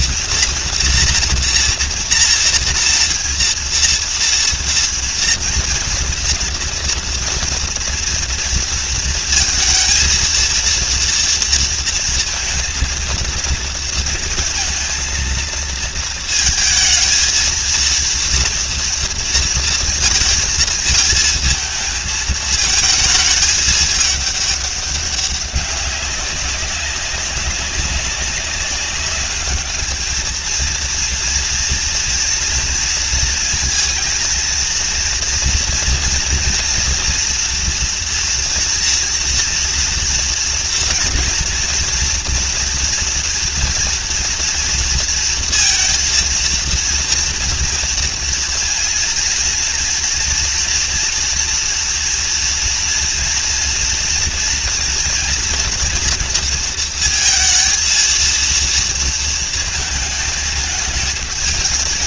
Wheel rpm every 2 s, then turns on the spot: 240, 240, 230, 230, 230, 230, 230, 230, 230, 230, 230, 220, 200, 200, 200, 230, 230, 230, 230, 240, 230, 230, 230, 230, 230, 230, 230, 230, 230, 230, 220.
none